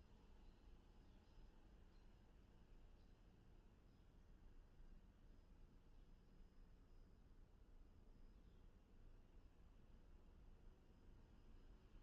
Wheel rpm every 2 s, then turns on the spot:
0, 0, 0, 0, 0, 0.
none